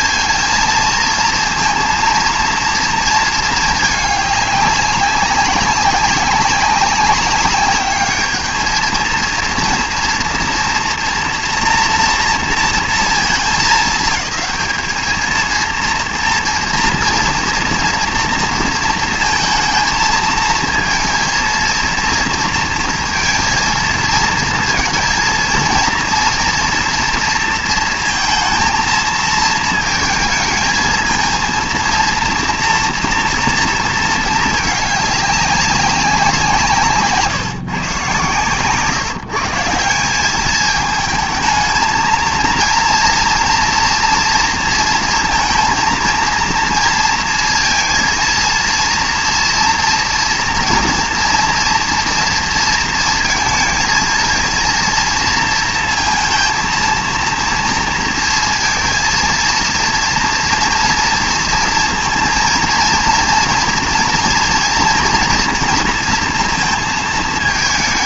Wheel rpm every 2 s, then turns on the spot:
230, 230, 200, 190, 220, 230, 230, 220, 230, 220, 230, 230, 230, 230, 230, 220, 230, 210, 150, 150, 210, 230, 230, 230, 230, 230, 230, 230, 230, 230, 230, 230, 230, 230.
none